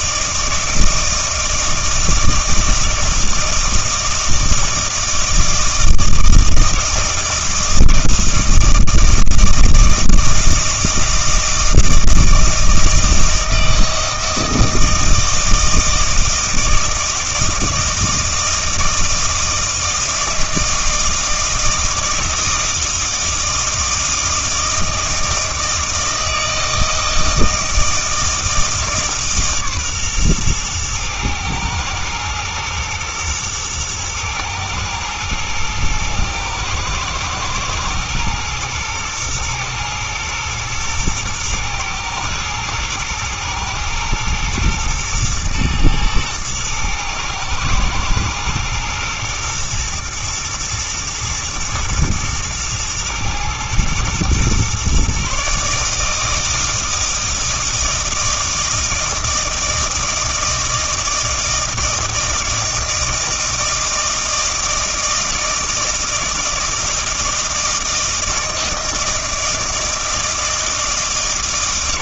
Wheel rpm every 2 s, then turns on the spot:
160, 160, 160, 160, 160, 160, 160, 160, 160, 160, 160, 160, 160, 160, 160, 120, 110, 110, 110, 120, 110, 120, 120, 110, 120, 110, 120, 130, 160, 160, 160, 160, 160, 160, 160, 160.
none